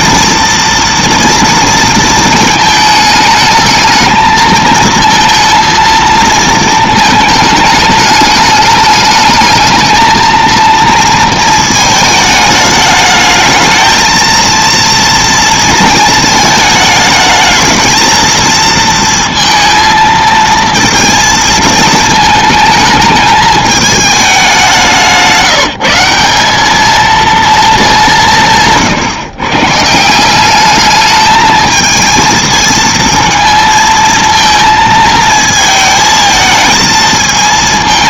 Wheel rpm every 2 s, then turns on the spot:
230, 220, 230, 220, 210, 230, 210, 230, 220, 230, 230, 220, 190, 210, 150, 210, 220, 230, 220.
none